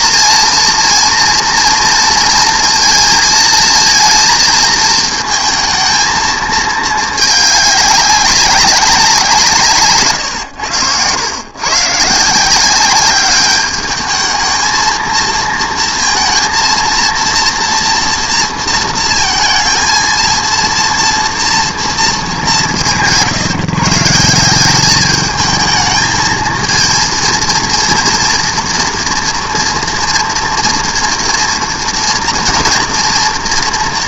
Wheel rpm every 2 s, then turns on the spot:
240, 230, 230, 220, 200, 100, 180, 220, 230, 230, 230, 170, 200, 230, 230, 230, 230.
none